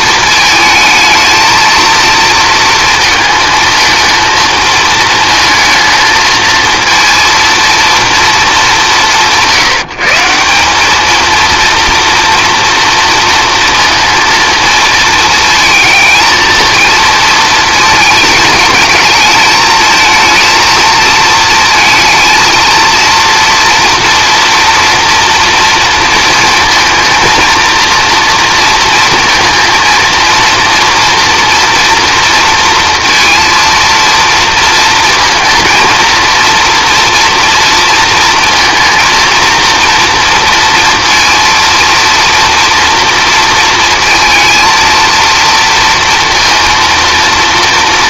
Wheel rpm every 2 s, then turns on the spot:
220, 230, 220, 230, 200, 210, 230, 230, 230, 210, 220, 230, 230, 230, 230, 230, 220, 230, 230, 230, 230, 230, 230, 230.
none